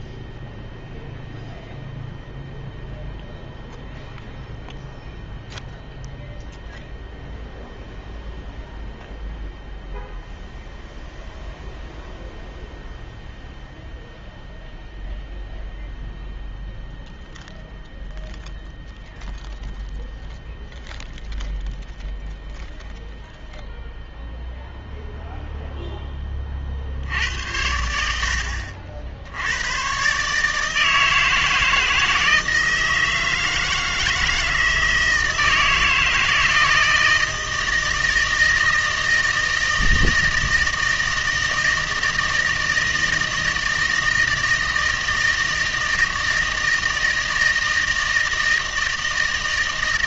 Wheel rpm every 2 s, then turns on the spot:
0, 0, 0, 0, 0, 0, 0, 0, 0, 0, 0, 0, 0, 60, 60, 160, 160, 160, 160, 160, 160, 160, 160, 160, 160.
none